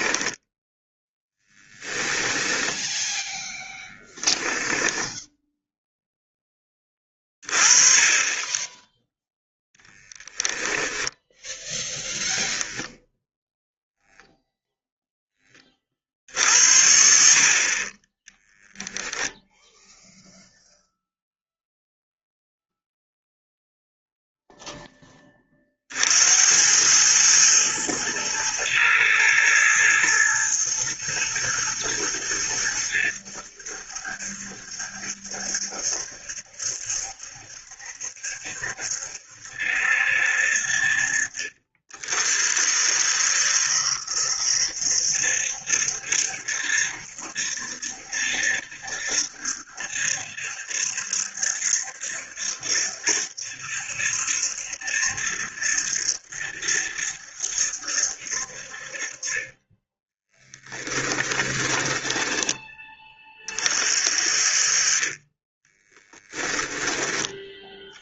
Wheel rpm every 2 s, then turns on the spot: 0, 10, 10, 20, 10, 10, 0, 0, 60, 0, 0, 0, 10, 100, 110, 120, 100, 70, 70, 70, 60, 60, 70, 70, 70, 70, 70, 70, 70, 50, 10, 20, 40, 10.
2-4 10-12 60-62 66-68